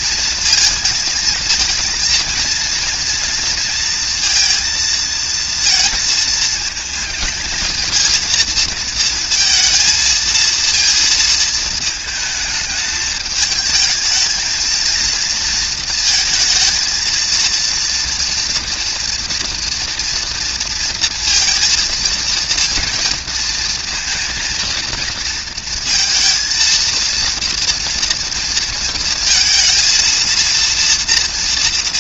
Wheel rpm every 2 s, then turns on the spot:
230, 230, 230, 220, 230, 230, 210, 220, 230, 230, 230, 230, 230, 230, 230, 230.
none